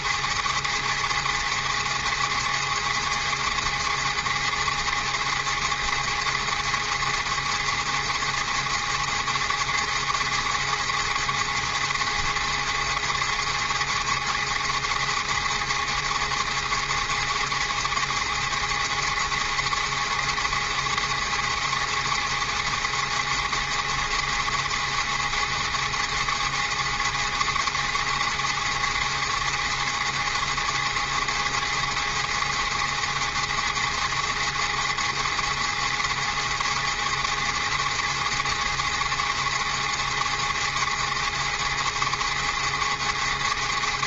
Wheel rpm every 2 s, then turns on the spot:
290, 290, 290, 290, 290, 290, 290, 290, 290, 290, 290, 290, 290, 290, 290, 290, 290, 290, 290, 290, 290, 290.
none